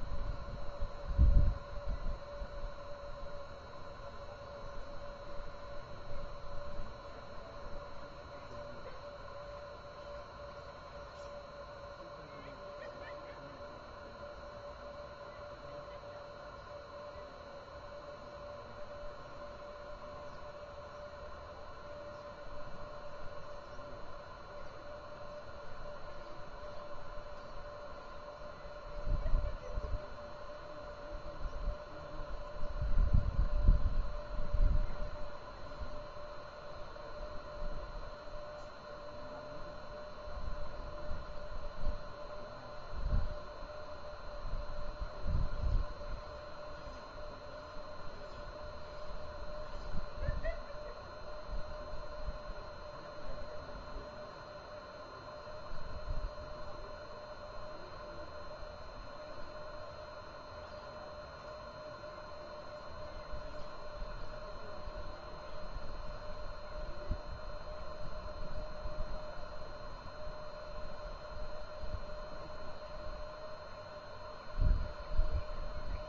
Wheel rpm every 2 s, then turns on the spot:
0, 0, 0, 0, 0, 0, 0, 0, 0, 0, 0, 0, 0, 0, 0, 0, 0, 0, 0, 0, 0, 0, 0, 0, 0, 0, 0, 0, 0, 0, 0, 0, 0, 0, 0, 0, 0, 0.
none